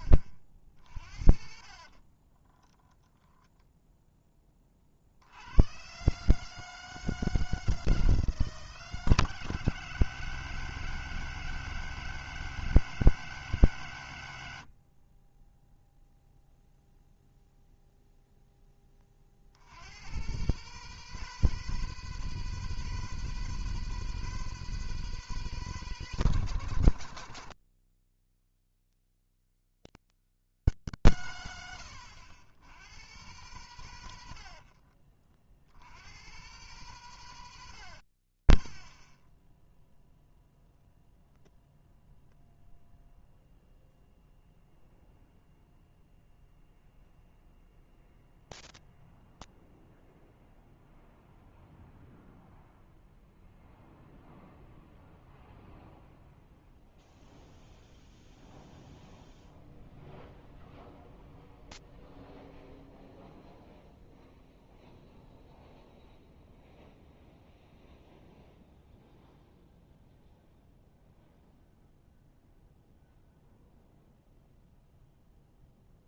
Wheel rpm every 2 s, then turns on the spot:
50, 10, 50, 160, 160, 160, 160, 40, 0, 20, 150, 160, 160, 120, 130, 140, 100, 50, 130, 30, 0, 0, 0, 0, 0, 0, 0, 0, 0, 0, 0, 0, 0, 0, 0, 0, 0, 0.
2-4 34-36